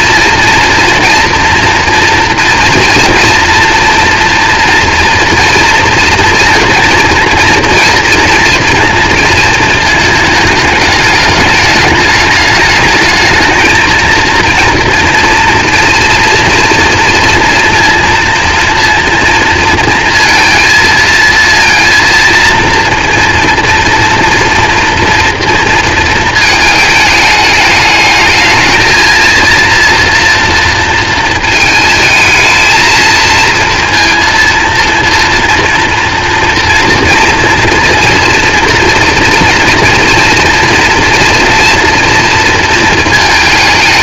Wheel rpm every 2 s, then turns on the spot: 230, 230, 230, 230, 230, 220, 210, 230, 230, 230, 230, 230, 230, 220, 220, 230, 220, 230, 230, 230, 230, 230.
none